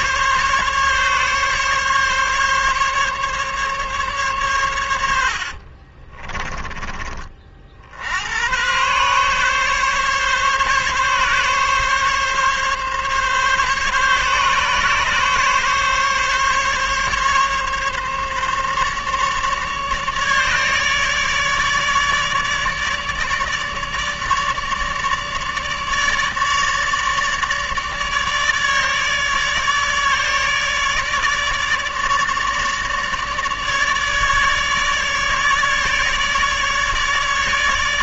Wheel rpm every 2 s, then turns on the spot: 140, 140, 90, 30, 120, 140, 140, 140, 140, 150, 150, 150, 150, 150, 150, 150, 150, 150, 150.
4-6